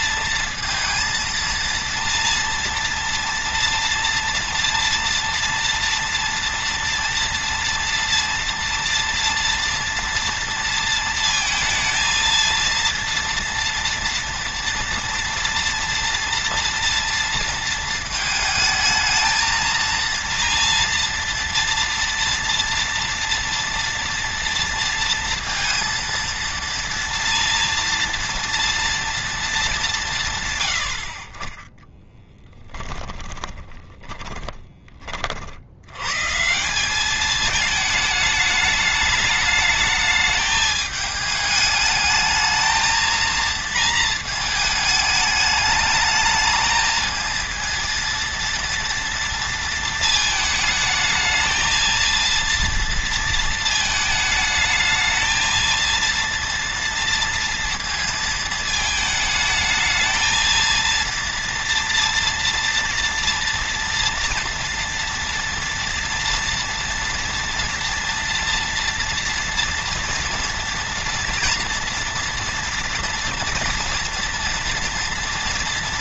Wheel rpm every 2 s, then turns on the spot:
230, 230, 230, 230, 240, 230, 230, 230, 230, 220, 230, 230, 230, 230, 230, 90, 20, 30, 190, 210, 210, 230, 220, 220, 230, 220, 230, 220, 230, 220, 230, 230, 240, 240, 230, 230, 240, 230.
32-34